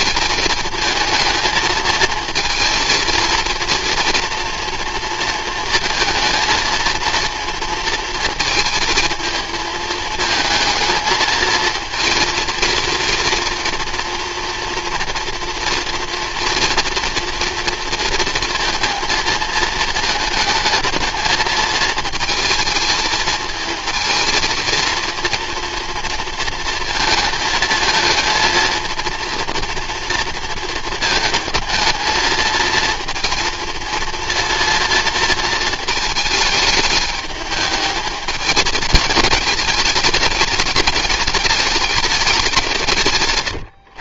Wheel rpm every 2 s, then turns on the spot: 220, 230, 230, 230, 220, 220, 230, 230, 230, 230, 220, 220, 230, 220, 230, 220, 220, 230, 210, 210, 210, 180.
none